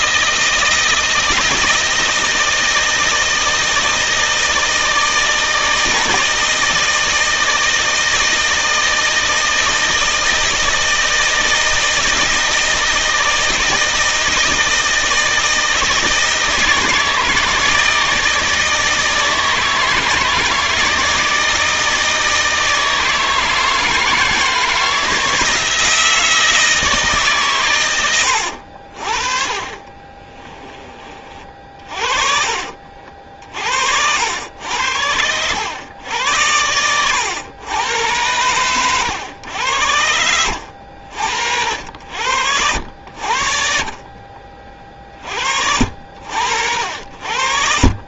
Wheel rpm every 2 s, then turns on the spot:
160, 160, 160, 160, 160, 160, 160, 160, 160, 160, 160, 160, 160, 160, 60, 20, 60, 90, 100, 100, 70, 80, 40, 70.
none